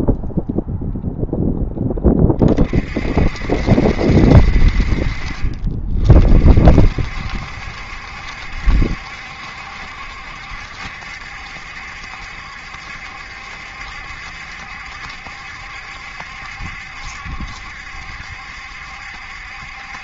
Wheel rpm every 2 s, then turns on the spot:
0, 40, 50, 60, 70, 70, 70, 70, 70, 70.
none